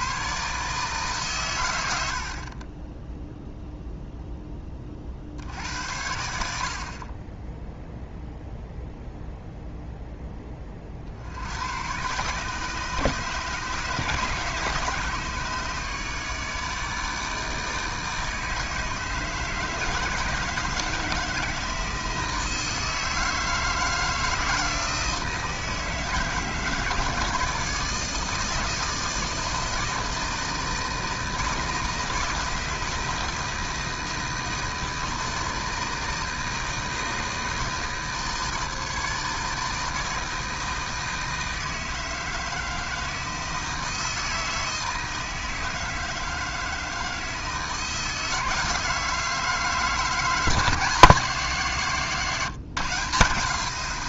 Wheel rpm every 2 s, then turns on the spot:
150, 20, 40, 50, 0, 40, 150, 150, 150, 160, 160, 160, 160, 160, 160, 160, 160, 160, 160, 160, 160, 160, 160, 160, 160, 160, 150.
none